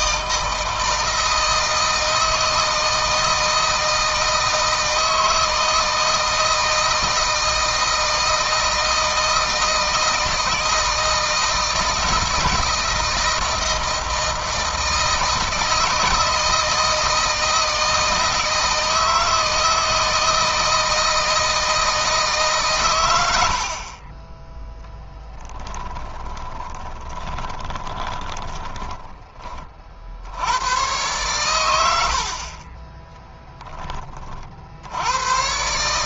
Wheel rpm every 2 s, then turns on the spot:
160, 160, 160, 160, 160, 160, 170, 160, 160, 160, 160, 130, 20, 20, 20, 100, 50, 50.
26-30